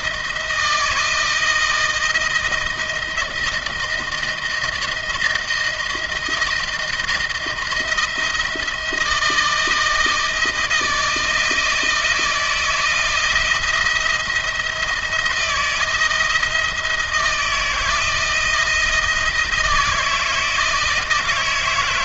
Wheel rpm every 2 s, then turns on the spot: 160, 160, 170, 170, 160, 160, 170, 160, 160, 160, 160.
none